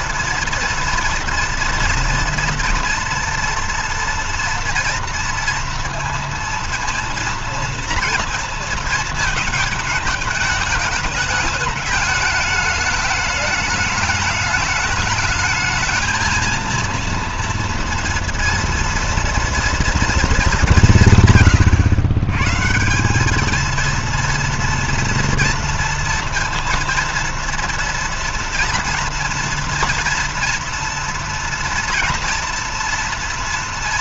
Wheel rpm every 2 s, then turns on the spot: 230, 230, 240, 230, 230, 220, 210, 210, 230, 230, 200, 130, 230, 230, 230, 230, 230.
none